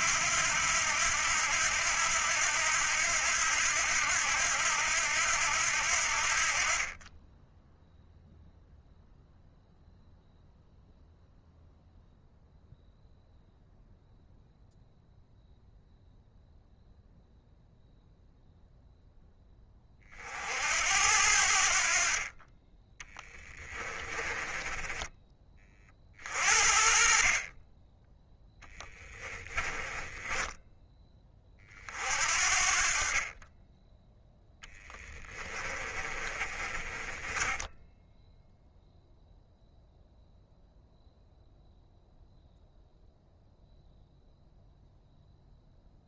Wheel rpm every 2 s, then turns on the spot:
80, 80, 80, 30, 0, 0, 0, 0, 0, 0, 70, 20, 20, 50, 10, 10, 40, 10, 30, 0, 0, 0, 0.
22-26 28-30 34-38